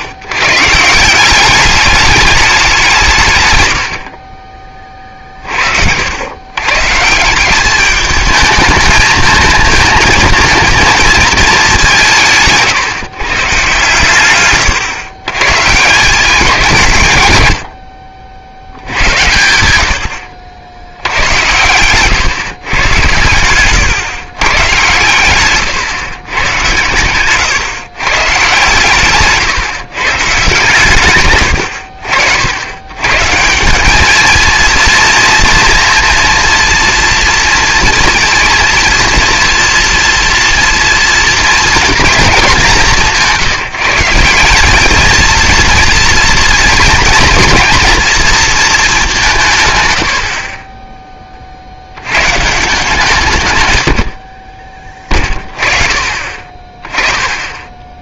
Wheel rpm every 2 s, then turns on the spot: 140, 200, 30, 120, 220, 230, 150, 120, 170, 80, 70, 130, 130, 120, 130, 140, 90, 230, 230, 230, 240, 200, 190, 230, 230, 40, 150, 30, 30.
12-14